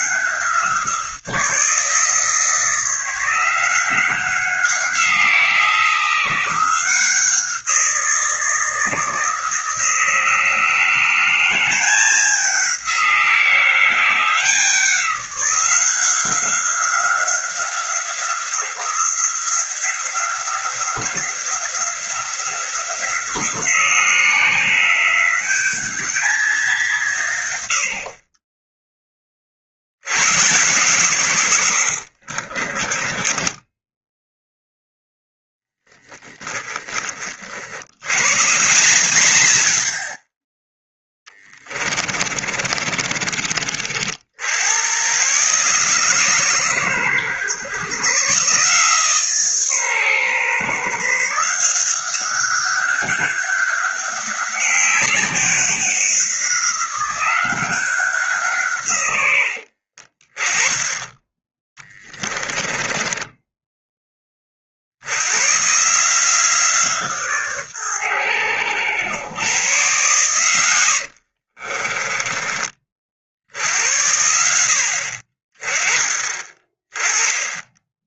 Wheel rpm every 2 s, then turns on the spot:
170, 170, 180, 180, 160, 180, 180, 180, 190, 180, 180, 180, 190, 170, 10, 130, 30, 0, 20, 150, 10, 40, 110, 120, 150, 150, 200, 200, 190, 130, 20, 20, 80, 160, 90, 90, 40, 60, 20.
32-34 40-44 62-64 70-72